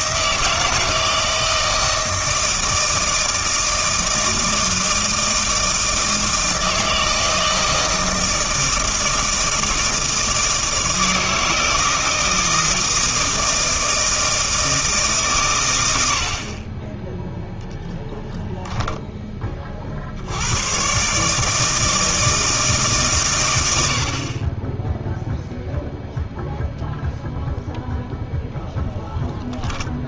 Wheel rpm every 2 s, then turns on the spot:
160, 160, 160, 160, 160, 160, 160, 160, 20, 0, 110, 150, 10, 0, 0.
none